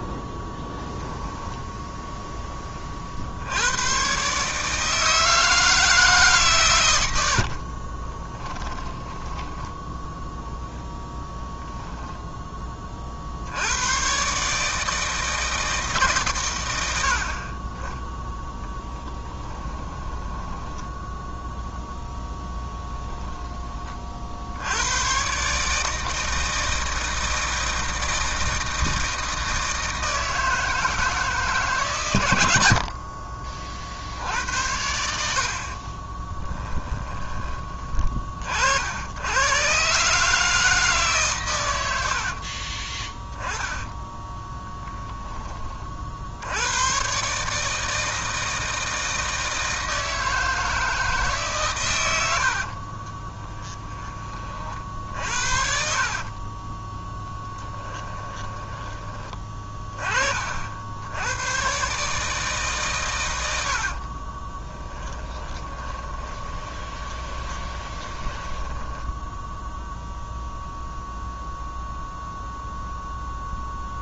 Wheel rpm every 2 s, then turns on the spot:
10, 30, 160, 110, 10, 10, 30, 160, 90, 10, 10, 10, 100, 160, 160, 160, 60, 80, 10, 70, 150, 20, 10, 90, 160, 160, 50, 50, 20, 20, 60, 140, 20, 20, 10, 0, 0.
8-12 18-22 42-44 52-54 56-58 64-70